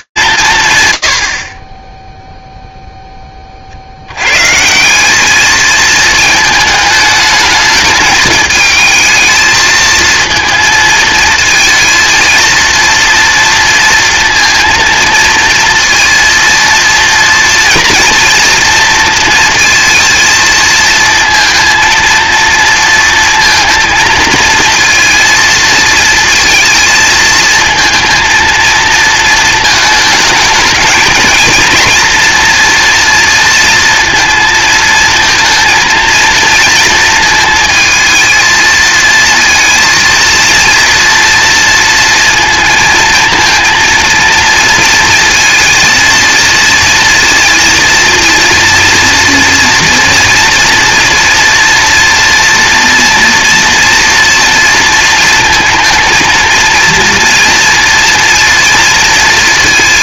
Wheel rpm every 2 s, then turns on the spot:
140, 0, 160, 220, 220, 230, 230, 230, 230, 230, 230, 230, 230, 230, 230, 220, 230, 230, 230, 220, 230, 220, 230, 230, 230, 230, 230, 230, 230, 230.
none